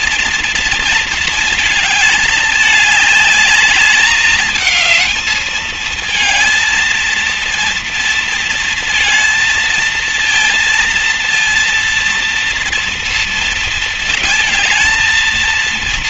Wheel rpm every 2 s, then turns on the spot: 230, 210, 210, 230, 230, 230, 240, 220.
none